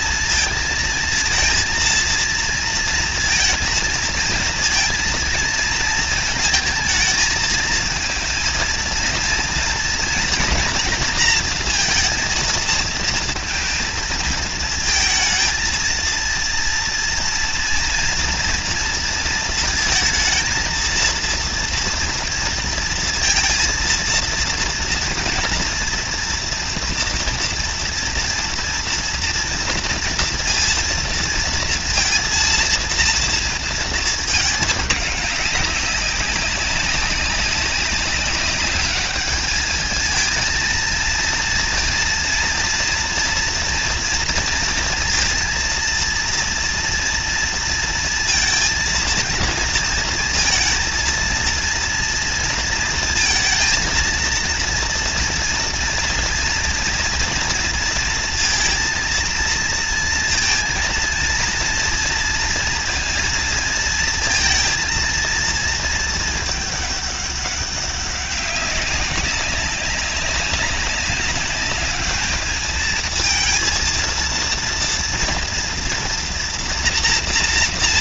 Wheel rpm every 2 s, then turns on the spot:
230, 230, 230, 230, 230, 240, 230, 230, 230, 230, 220, 230, 230, 240, 230, 230, 230, 220, 200, 200, 220, 230, 230, 230, 230, 230, 230, 230, 230, 230, 230, 230, 220, 220, 200, 190, 210, 230, 240.
none